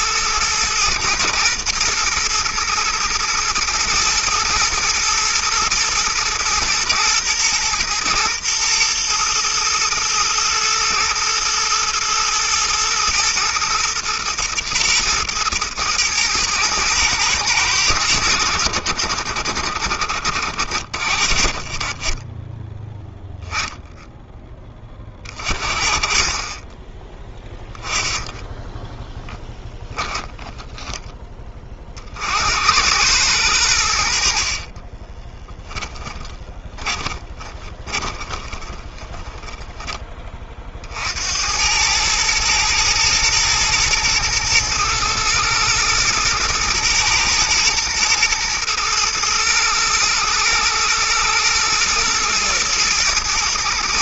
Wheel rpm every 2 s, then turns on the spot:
110, 110, 110, 120, 120, 110, 120, 120, 110, 70, 70, 10, 20, 20, 20, 10, 100, 30, 20, 20, 50, 110, 110, 120, 120, 110, 110.
28-30 34-40